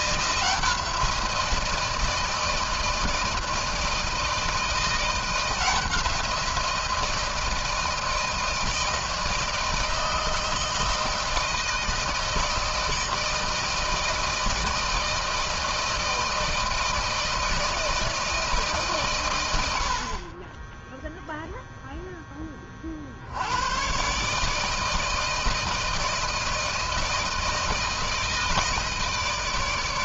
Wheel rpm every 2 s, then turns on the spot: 170, 160, 160, 170, 160, 160, 160, 160, 160, 160, 30, 10, 140, 160, 160.
none